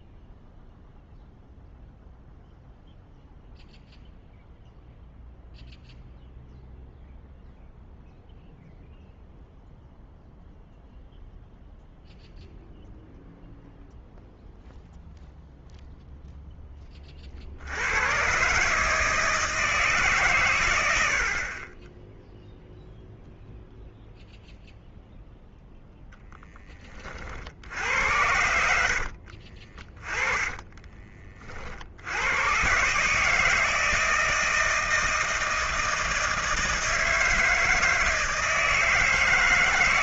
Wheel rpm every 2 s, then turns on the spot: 0, 0, 0, 0, 0, 0, 0, 0, 10, 130, 120, 0, 0, 20, 70, 20, 110, 160, 160, 160.
28-32